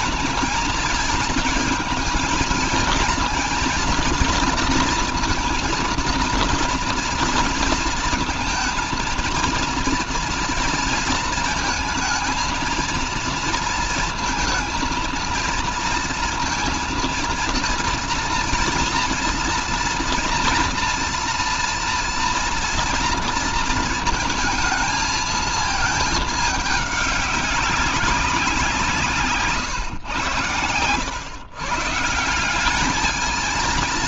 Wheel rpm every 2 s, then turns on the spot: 220, 220, 230, 230, 230, 230, 230, 230, 230, 230, 230, 240, 230, 200, 170, 120, 200.
none